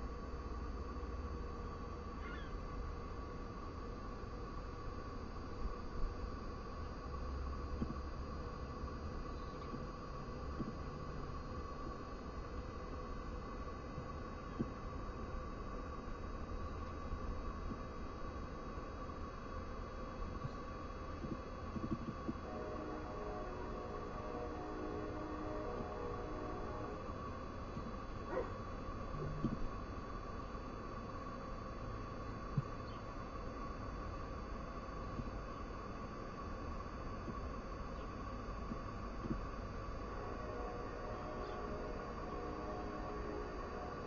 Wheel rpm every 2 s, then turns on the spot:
0, 0, 0, 0, 0, 0, 0, 0, 0, 0, 0, 0, 0, 0, 0, 0, 0, 0, 0, 0, 0, 0.
none